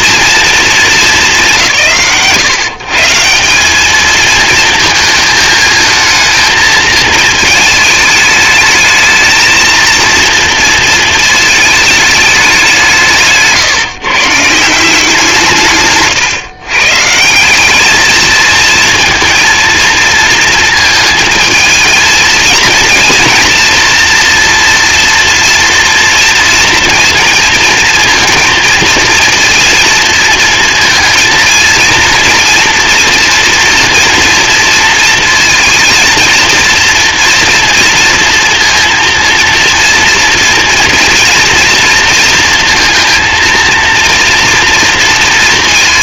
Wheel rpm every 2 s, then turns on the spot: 220, 140, 220, 220, 220, 230, 180, 170, 140, 230, 220, 230, 230, 230, 230, 230, 230, 230, 230, 230, 230, 230, 230.
none